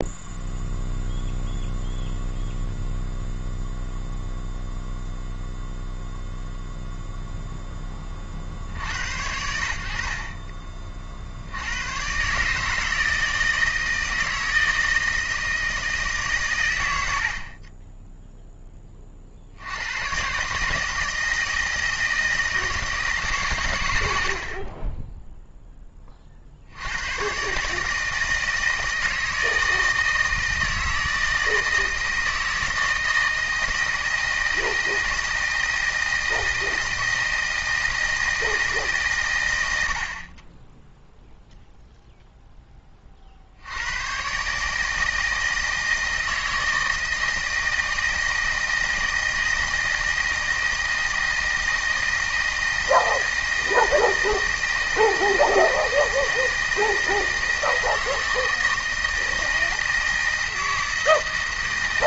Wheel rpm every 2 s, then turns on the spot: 0, 0, 0, 0, 90, 30, 150, 160, 80, 30, 160, 160, 20, 90, 160, 160, 160, 160, 160, 150, 0, 20, 160, 160, 160, 160, 160, 160, 160, 160, 160.
none